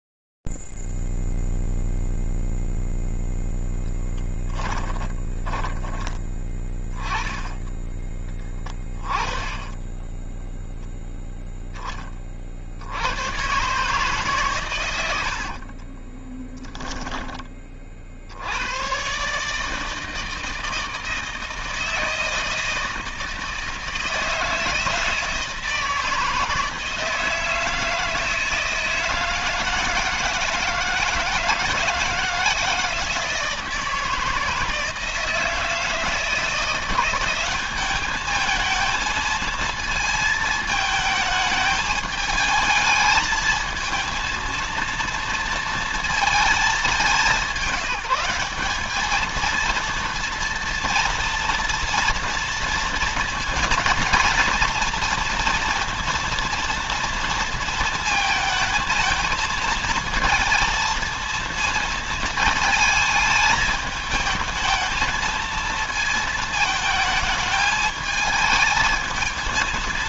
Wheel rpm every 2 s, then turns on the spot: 0, 0, 10, 10, 10, 10, 60, 130, 10, 110, 160, 160, 160, 160, 160, 160, 160, 160, 180, 220, 220, 220, 230, 200, 220, 230, 230, 230, 230, 220, 230, 220, 220, 210, 220.
4-6 10-12